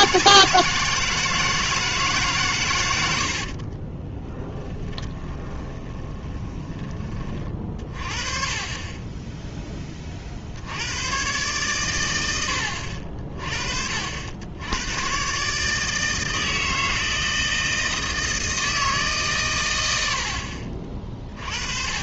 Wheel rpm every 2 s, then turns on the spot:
160, 100, 20, 20, 20, 80, 60, 100, 160, 160, 40.
4-6